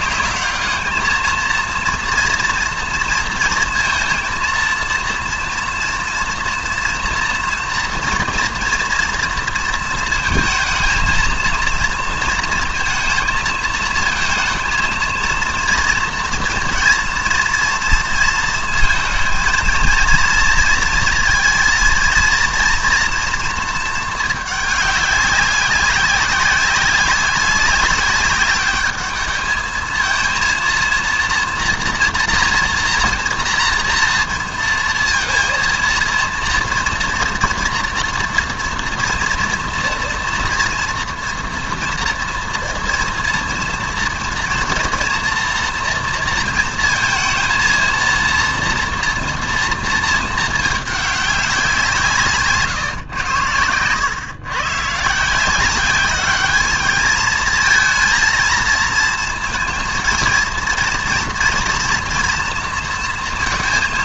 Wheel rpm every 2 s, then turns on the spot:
210, 230, 230, 230, 230, 220, 230, 230, 230, 230, 230, 230, 210, 190, 200, 230, 240, 230, 230, 230, 230, 230, 230, 230, 230, 220, 150, 120, 210, 230, 230, 230.
none